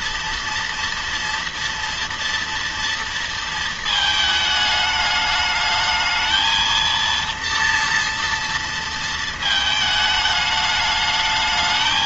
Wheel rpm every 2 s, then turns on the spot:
230, 230, 210, 220, 230, 210.
none